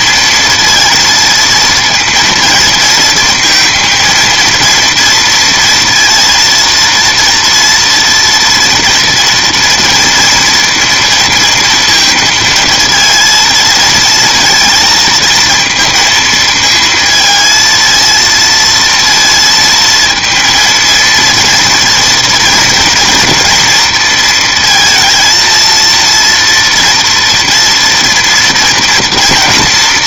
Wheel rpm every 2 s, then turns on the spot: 230, 230, 230, 230, 230, 230, 230, 230, 220, 230, 230, 230, 230, 230, 230.
none